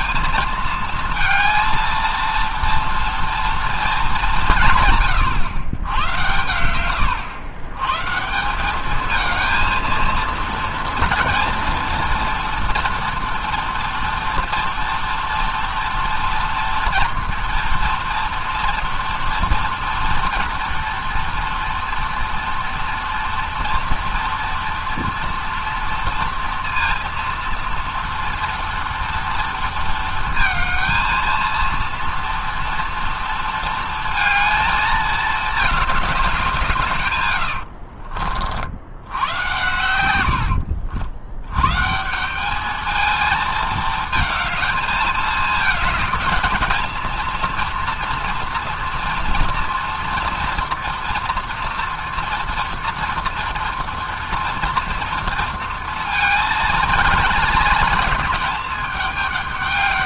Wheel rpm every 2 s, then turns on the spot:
230, 230, 130, 110, 220, 230, 240, 230, 240, 240, 230, 230, 230, 230, 230, 230, 230, 220, 90, 100, 100, 220, 220, 230, 240, 240, 230, 230, 220, 210.
36-38